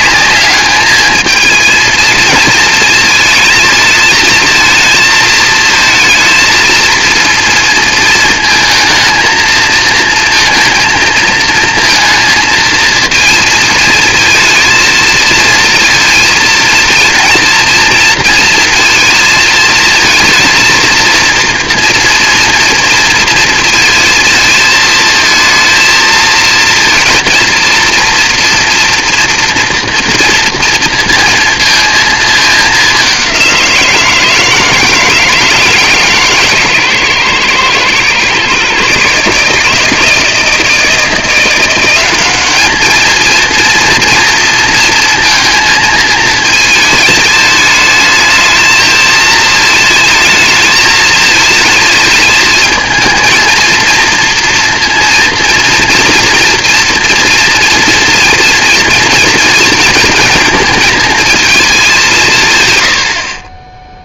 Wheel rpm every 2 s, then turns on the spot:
220, 220, 220, 230, 220, 220, 230, 230, 230, 230, 230, 230, 230, 230, 230, 230, 200, 160, 120, 140, 170, 220, 230, 220, 220, 220, 230, 230, 230, 230, 220, 150.
none